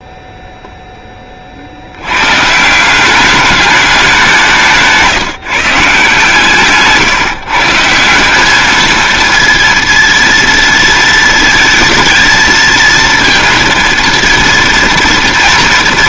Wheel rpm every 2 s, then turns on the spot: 0, 170, 160, 150, 220, 230, 230, 230.
4-6